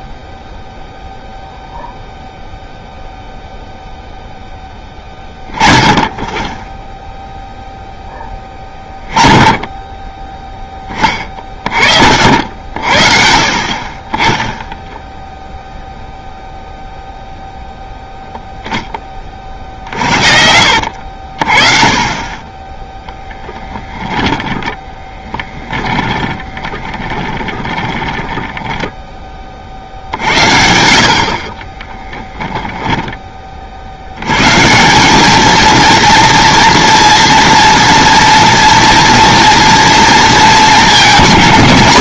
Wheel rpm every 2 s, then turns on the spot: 0, 0, 10, 0, 10, 20, 50, 0, 0, 20, 60, 10, 10, 30, 10, 60, 10, 180, 230, 230, 210.
24-28